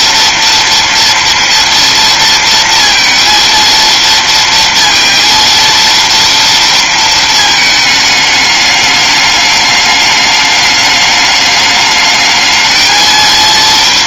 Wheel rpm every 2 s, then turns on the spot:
230, 230, 230, 220, 210, 210, 230.
none